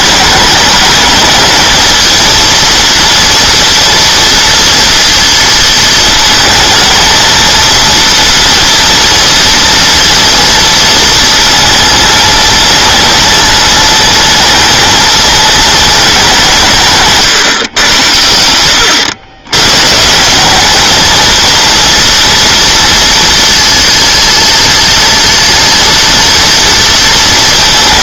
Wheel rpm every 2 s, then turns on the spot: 210, 230, 230, 230, 230, 230, 220, 220, 170, 100, 210, 230, 230, 230.
18-20